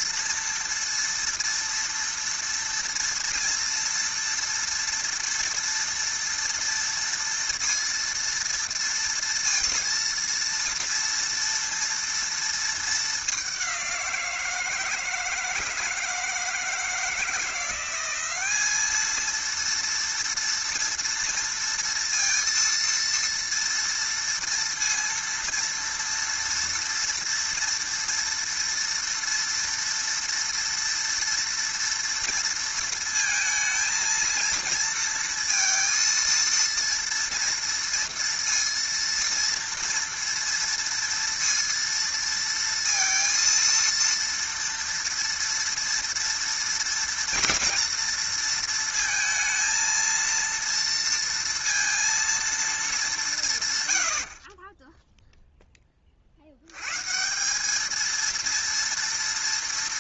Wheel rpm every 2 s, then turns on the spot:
230, 240, 230, 230, 230, 230, 230, 170, 160, 200, 230, 230, 230, 230, 230, 230, 230, 230, 230, 230, 230, 230, 230, 230, 230, 230, 230, 40, 70, 230.
none